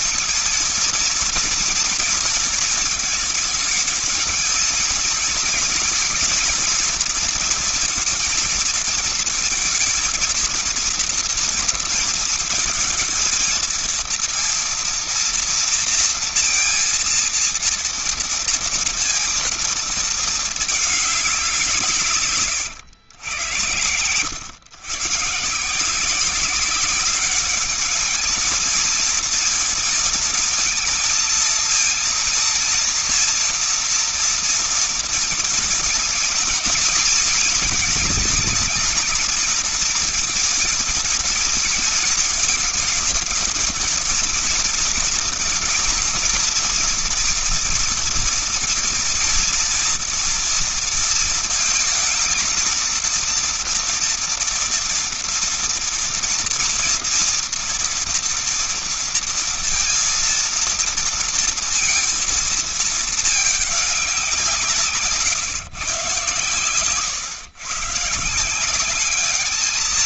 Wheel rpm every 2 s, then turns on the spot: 230, 230, 220, 230, 230, 230, 220, 230, 230, 230, 220, 140, 110, 190, 220, 230, 230, 230, 220, 220, 230, 220, 230, 230, 230, 230, 230, 230, 230, 240, 230, 230, 170, 110, 160.
none